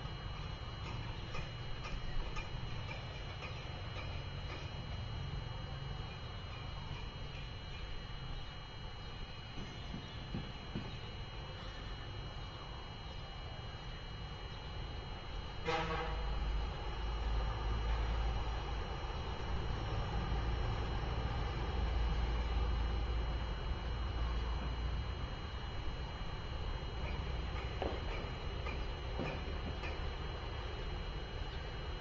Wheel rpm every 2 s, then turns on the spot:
0, 0, 0, 0, 0, 0, 0, 0, 0, 0, 0, 0, 0, 0, 0, 0.
none